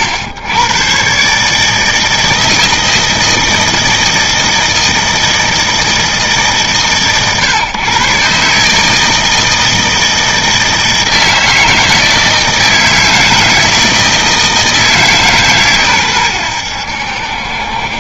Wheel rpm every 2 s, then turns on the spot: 110, 160, 160, 150, 150, 160, 160, 160, 100.
none